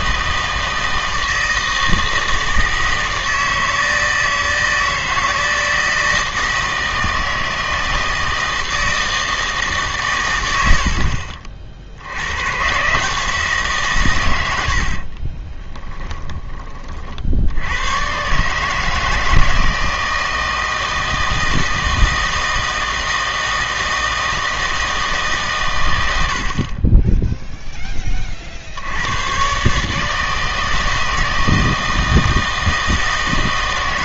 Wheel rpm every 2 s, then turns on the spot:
160, 160, 160, 160, 160, 80, 130, 70, 40, 150, 160, 160, 160, 40, 70, 160, 160.
14-16